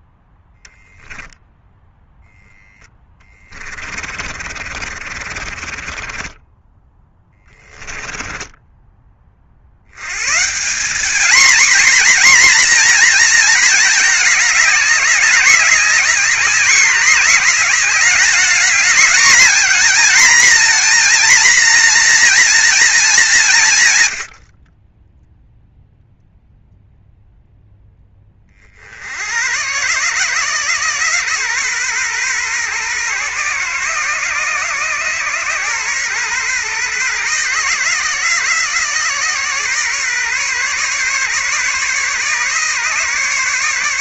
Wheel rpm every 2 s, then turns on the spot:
10, 10, 50, 10, 20, 200, 240, 200, 200, 220, 240, 230, 30, 0, 40, 130, 130, 130, 130, 130, 140, 140.
2-6